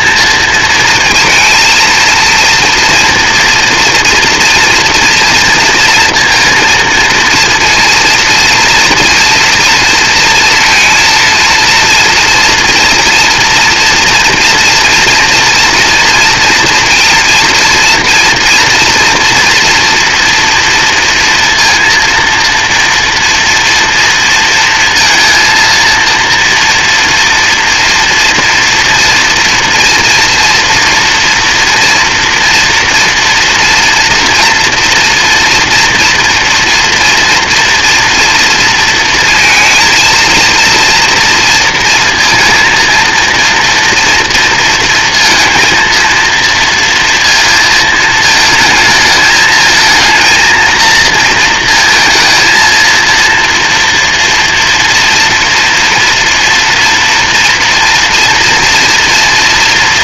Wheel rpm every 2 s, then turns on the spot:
230, 240, 240, 230, 230, 230, 240, 240, 230, 230, 230, 230, 230, 230, 230, 230, 230, 240, 240, 230, 230, 230, 230, 230, 220, 230, 230, 230, 230, 240.
none